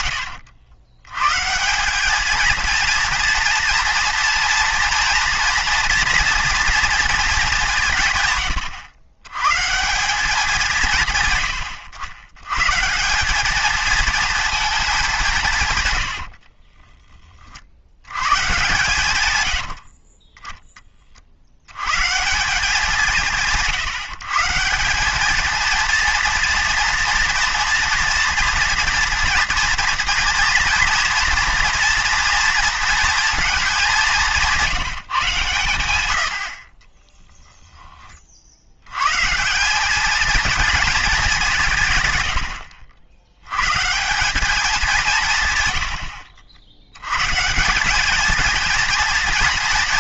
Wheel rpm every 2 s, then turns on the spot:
100, 230, 230, 230, 110, 170, 120, 220, 40, 120, 20, 170, 160, 240, 230, 240, 230, 180, 50, 70, 230, 90, 200, 80, 230.
8-10 16-20 42-44